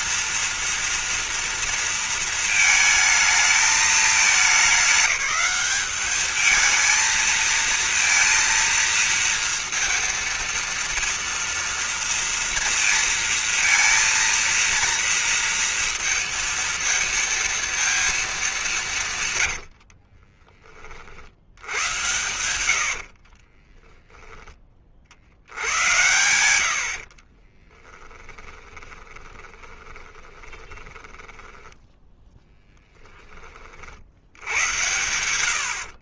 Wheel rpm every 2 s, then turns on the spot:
230, 230, 210, 220, 230, 230, 230, 230, 230, 200, 30, 90, 10, 80, 10, 20, 10, 90.
20-22 28-32